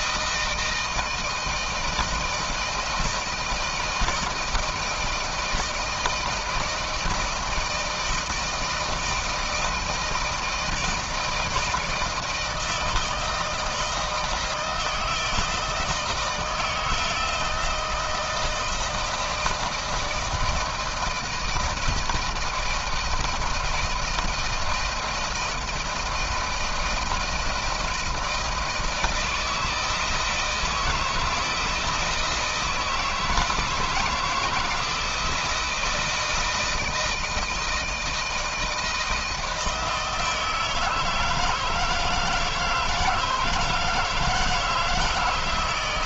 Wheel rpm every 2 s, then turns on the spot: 160, 160, 170, 160, 160, 160, 160, 160, 160, 160, 160, 160, 170, 170, 160, 160, 160, 160, 160, 160, 160, 160, 160.
none